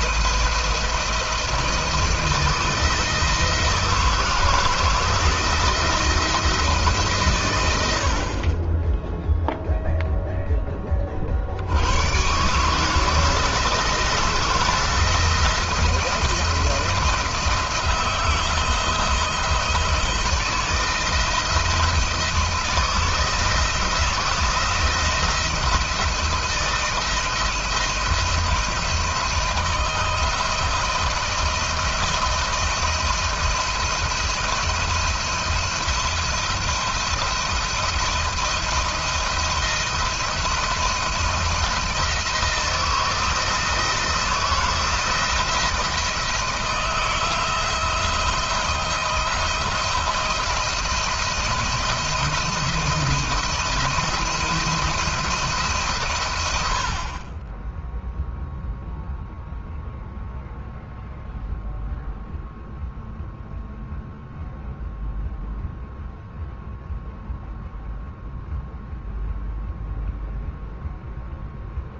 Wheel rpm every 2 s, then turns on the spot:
160, 160, 160, 160, 20, 10, 140, 170, 170, 170, 170, 160, 170, 170, 160, 170, 170, 170, 170, 170, 170, 160, 160, 170, 170, 160, 170, 160, 30, 0, 0, 0, 0, 0, 0, 0.
none